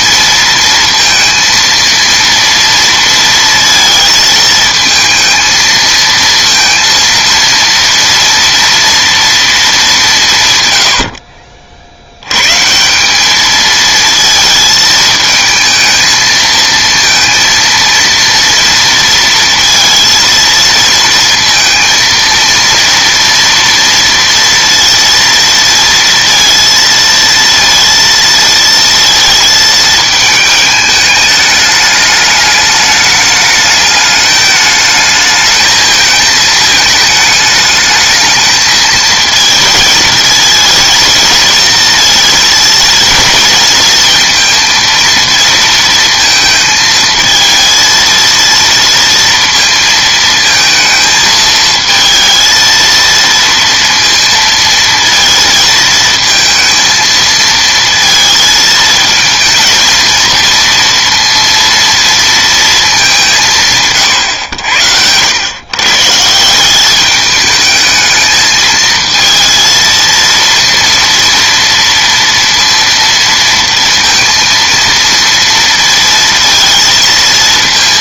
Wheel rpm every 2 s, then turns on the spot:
230, 230, 220, 230, 240, 100, 160, 220, 230, 230, 230, 230, 230, 230, 230, 210, 210, 210, 220, 220, 220, 230, 230, 230, 230, 220, 230, 230, 220, 220, 230, 220, 90, 190, 220, 230, 230, 230, 220.
none